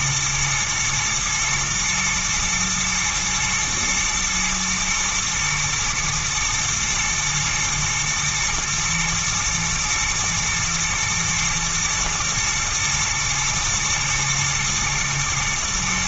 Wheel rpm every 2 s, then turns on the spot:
120, 110, 110, 120, 110, 120, 110, 110.
none